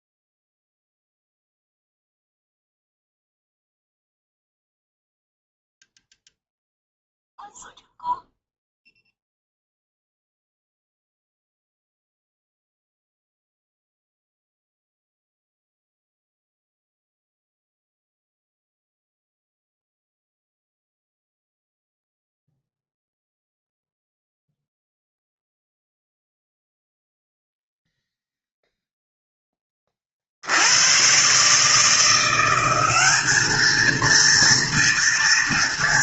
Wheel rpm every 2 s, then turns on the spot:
0, 0, 0, 0, 0, 0, 0, 0, 0, 0, 0, 0, 0, 0, 0, 80, 190, 230.
none